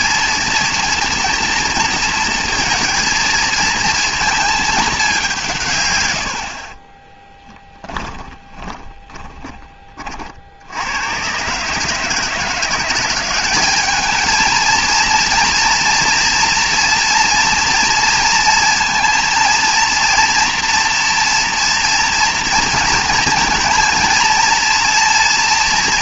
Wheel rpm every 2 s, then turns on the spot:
230, 220, 220, 50, 20, 70, 170, 220, 230, 230, 230, 230, 230.
8-10